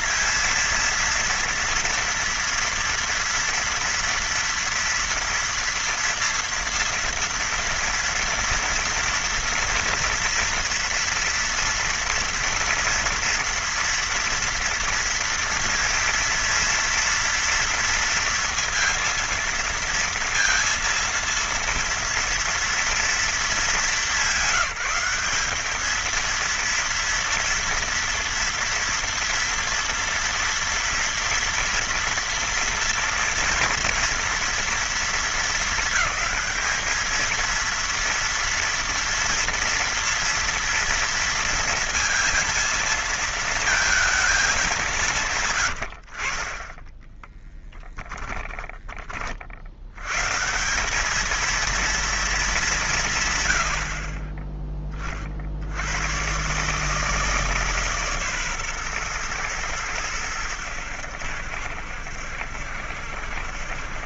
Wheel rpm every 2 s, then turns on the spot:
230, 240, 230, 240, 230, 230, 240, 230, 230, 230, 230, 230, 190, 230, 230, 230, 230, 230, 220, 230, 230, 220, 200, 20, 20, 170, 200, 20, 140, 130, 90, 70.
48-50